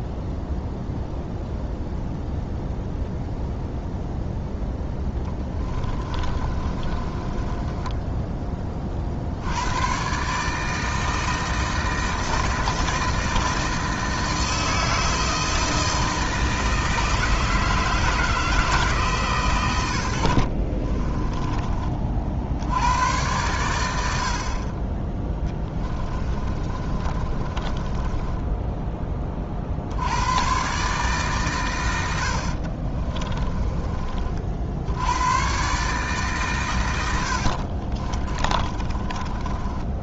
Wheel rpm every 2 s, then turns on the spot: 0, 0, 0, 30, 30, 160, 160, 160, 160, 150, 40, 90, 20, 30, 20, 140, 50, 80, 110, 30.
6-8 20-22 26-28 32-34 36-40